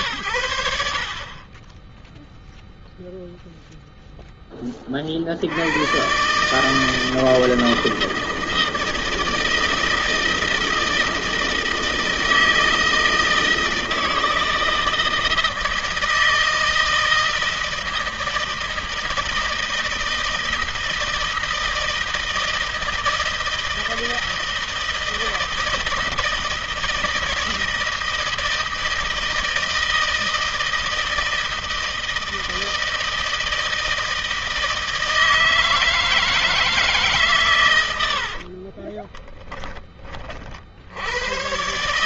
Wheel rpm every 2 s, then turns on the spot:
60, 0, 60, 160, 160, 160, 160, 160, 160, 160, 160, 160, 160, 160, 160, 160, 160, 160, 120, 20, 100.
38-40